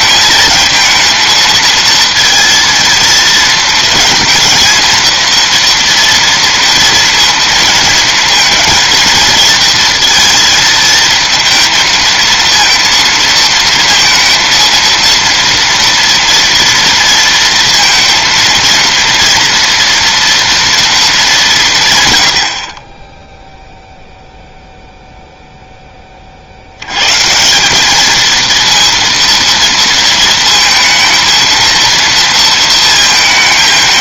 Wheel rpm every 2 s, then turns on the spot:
220, 230, 230, 230, 230, 230, 230, 230, 240, 230, 230, 80, 0, 70, 230, 230, 230.
none